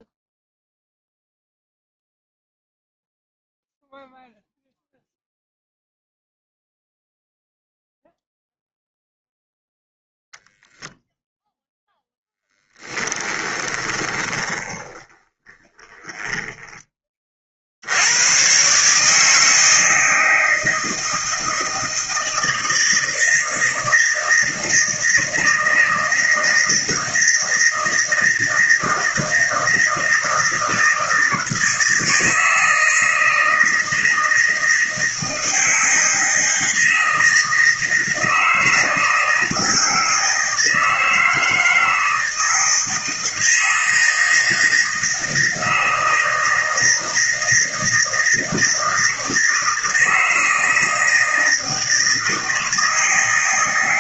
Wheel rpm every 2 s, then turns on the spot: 0, 0, 0, 0, 0, 0, 20, 30, 30, 150, 160, 160, 160, 160, 160, 160, 160, 160, 160, 160, 160, 160, 160, 160, 160, 160, 160.
12-16